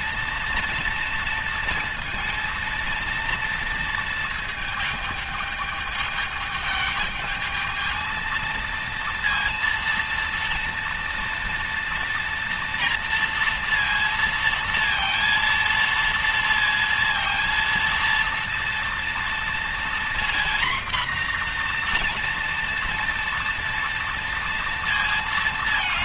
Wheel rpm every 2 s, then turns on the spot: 230, 230, 220, 220, 230, 230, 230, 230, 230, 230, 240, 230, 230.
none